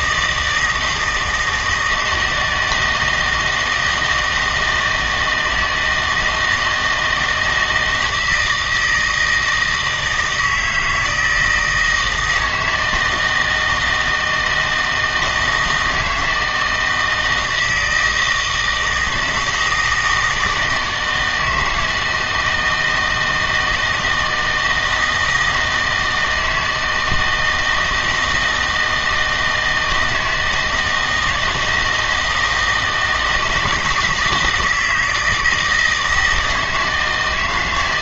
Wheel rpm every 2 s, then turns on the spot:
160, 160, 160, 160, 160, 160, 160, 160, 160, 160, 160, 160, 160, 160, 160, 160, 160, 170, 160.
none